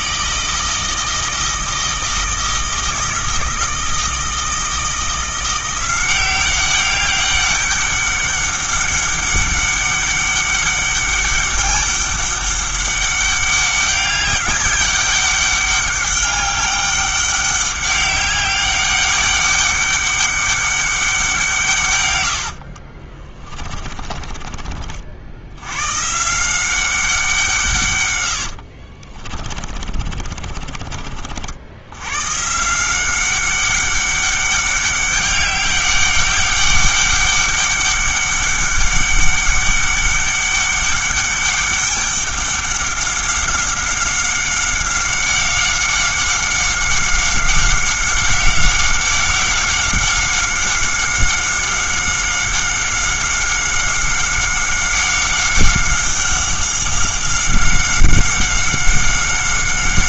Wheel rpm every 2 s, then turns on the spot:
160, 160, 160, 190, 200, 200, 200, 200, 200, 200, 200, 60, 40, 180, 70, 40, 160, 200, 200, 200, 200, 190, 190, 190, 190, 190, 190, 190, 190, 190.
22-24 28-32